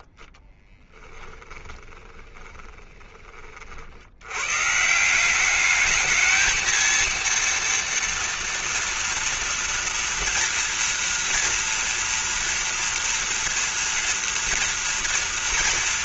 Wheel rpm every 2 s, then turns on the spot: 10, 20, 140, 230, 230, 230, 230, 230.
0-4